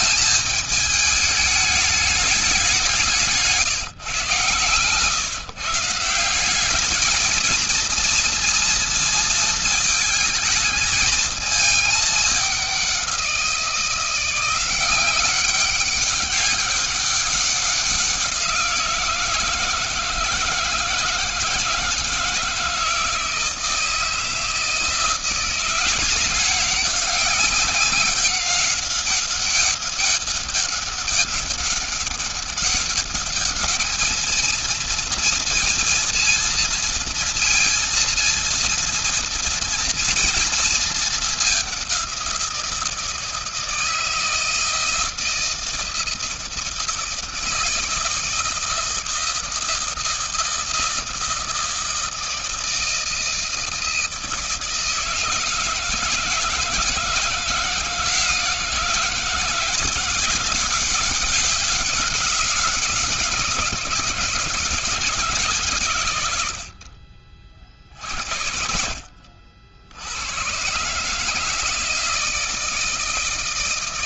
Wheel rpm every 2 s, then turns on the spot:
210, 190, 130, 200, 230, 220, 190, 180, 200, 170, 160, 160, 160, 190, 190, 200, 200, 230, 230, 230, 220, 170, 160, 160, 160, 160, 160, 160, 160, 170, 190, 180, 160, 60, 60, 130, 160.
66-68